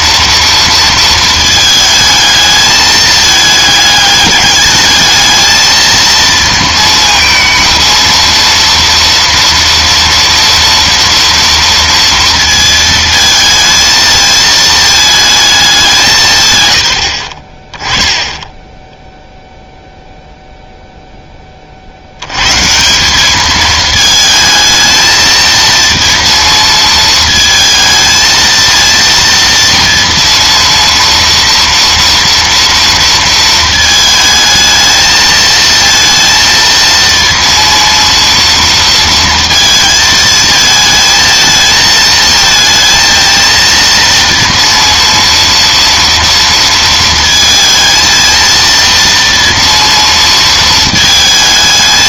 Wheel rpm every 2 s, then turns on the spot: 230, 220, 210, 230, 230, 230, 230, 220, 130, 10, 0, 140, 220, 230, 230, 230, 230, 220, 230, 230, 220, 220, 230, 230, 230, 230.
none